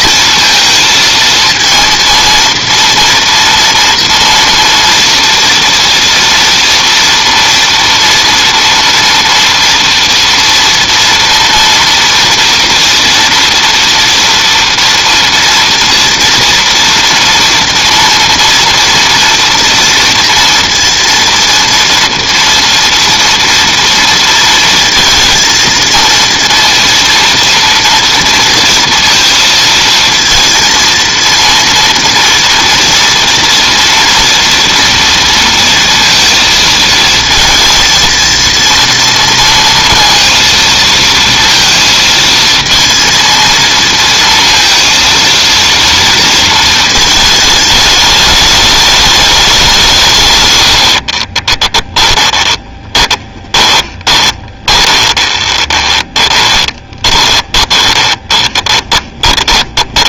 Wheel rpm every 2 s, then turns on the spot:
230, 230, 230, 230, 230, 230, 230, 230, 230, 230, 240, 240, 230, 230, 230, 230, 230, 230, 220, 230, 230, 230, 230, 230, 210, 90, 10, 20, 20, 20.
50-60